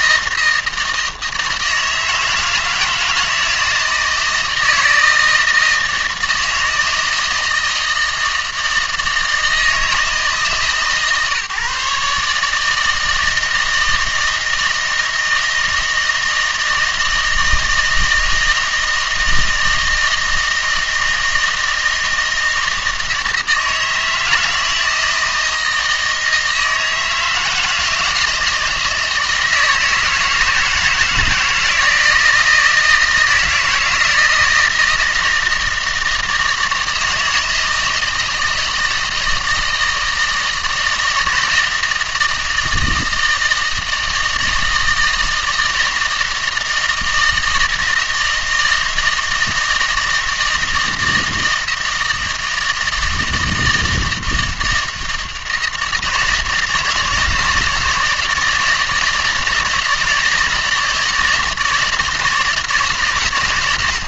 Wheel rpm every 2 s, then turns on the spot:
160, 160, 160, 160, 160, 150, 160, 160, 160, 160, 160, 160, 160, 160, 160, 160, 170, 160, 160, 160, 160, 160, 160, 160, 160, 160, 160, 160, 160, 160, 160, 150.
none